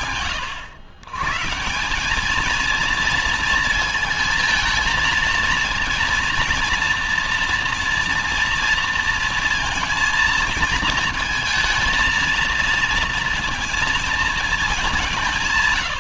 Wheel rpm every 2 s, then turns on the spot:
140, 220, 230, 230, 230, 230, 230, 160.
none